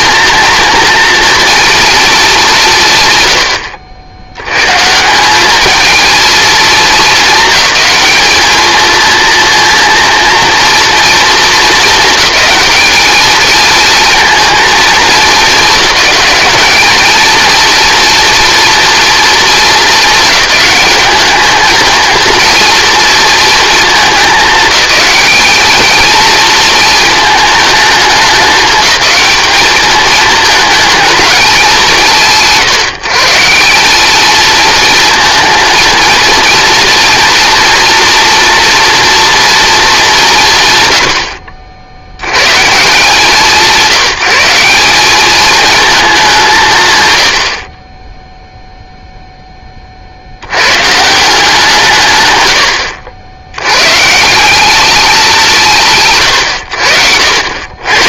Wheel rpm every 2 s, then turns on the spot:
230, 160, 120, 220, 220, 230, 210, 230, 210, 240, 210, 240, 220, 220, 210, 220, 130, 220, 240, 240, 140, 130, 190, 180, 0, 110, 100, 210, 100.
none